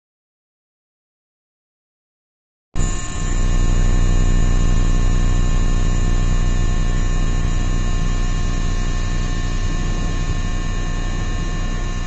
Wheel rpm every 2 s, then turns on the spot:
0, 0, 0, 0, 0, 0.
none